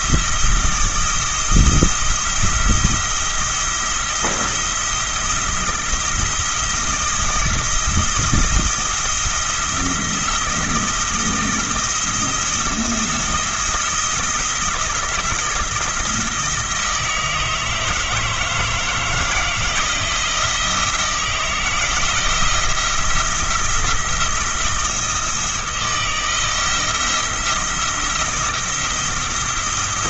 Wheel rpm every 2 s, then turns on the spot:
170, 170, 170, 170, 170, 170, 170, 170, 160, 160, 170, 170, 170, 170, 170.
none